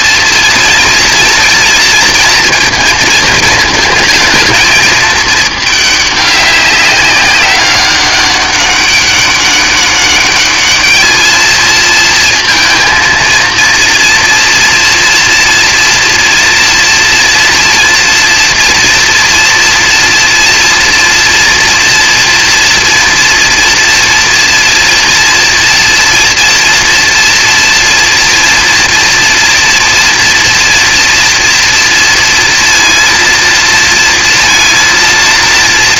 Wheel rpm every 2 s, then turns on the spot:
230, 230, 220, 210, 200, 200, 230, 230, 230, 230, 230, 230, 230, 230, 230, 240, 230, 230.
none